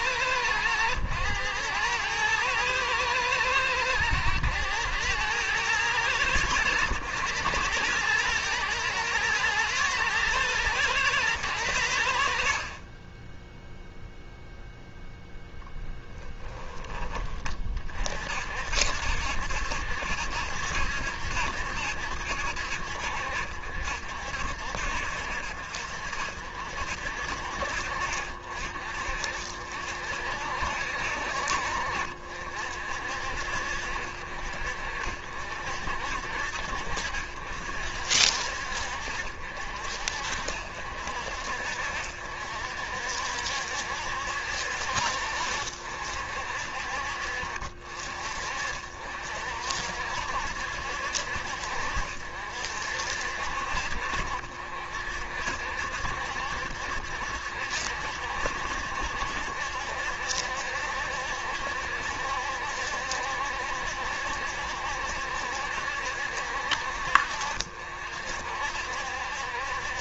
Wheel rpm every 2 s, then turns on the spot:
90, 110, 100, 100, 110, 120, 40, 0, 10, 60, 70, 70, 60, 60, 50, 60, 60, 60, 60, 60, 60, 60, 60, 60, 50, 70, 60, 60, 70, 70, 70, 70, 70, 60, 60.
none